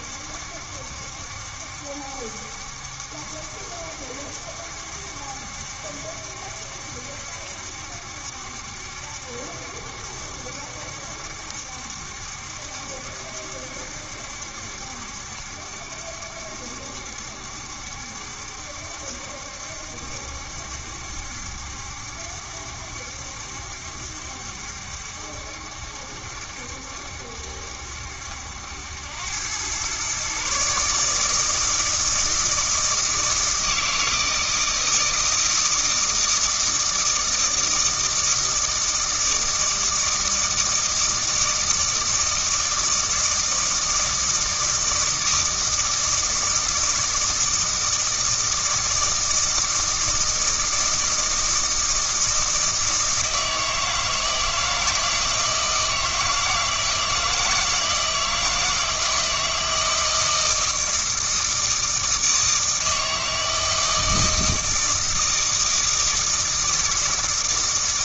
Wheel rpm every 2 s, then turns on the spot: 70, 70, 70, 70, 70, 70, 70, 70, 70, 70, 70, 70, 70, 70, 80, 140, 160, 160, 160, 160, 160, 160, 160, 160, 160, 160, 160, 160, 160, 160, 160, 160, 160, 160.
none